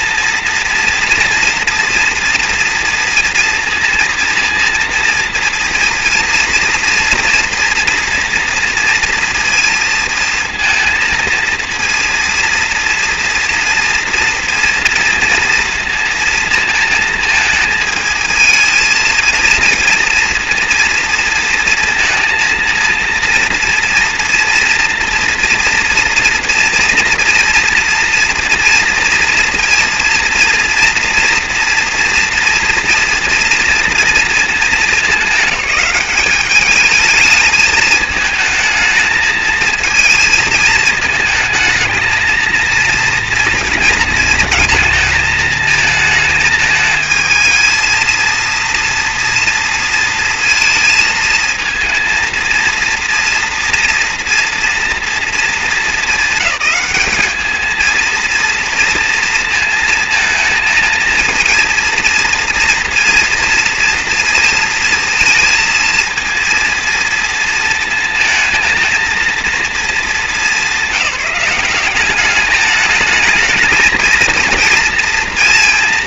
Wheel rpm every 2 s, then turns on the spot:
230, 230, 230, 230, 240, 230, 240, 230, 230, 220, 240, 230, 230, 230, 230, 230, 230, 220, 200, 220, 220, 230, 230, 220, 230, 220, 230, 230, 210, 230, 230, 230, 220, 230, 220, 210, 200, 230.
none